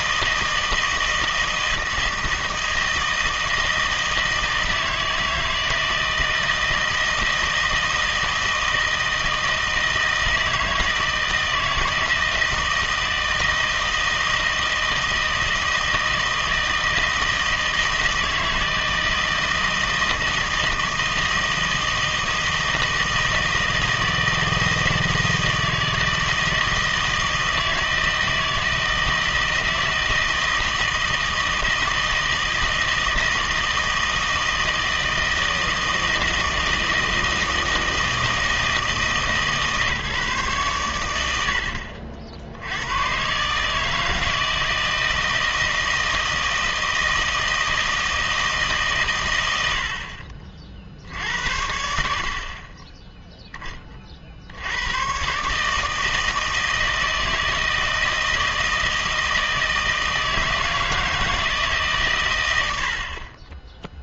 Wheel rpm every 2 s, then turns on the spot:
160, 160, 160, 160, 160, 160, 160, 160, 160, 160, 160, 160, 160, 160, 160, 160, 160, 160, 160, 160, 130, 90, 160, 160, 150, 50, 30, 90, 160, 160, 160, 80.
none